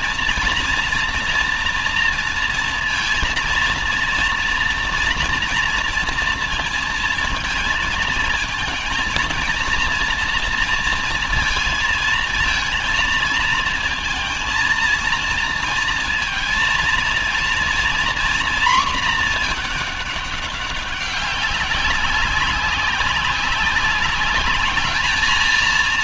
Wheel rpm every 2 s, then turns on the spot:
230, 230, 230, 230, 230, 230, 230, 230, 230, 240, 200, 190, 210.
none